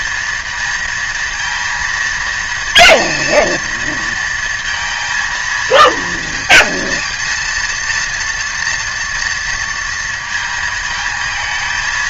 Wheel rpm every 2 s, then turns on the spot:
230, 230, 220, 230, 230, 220.
none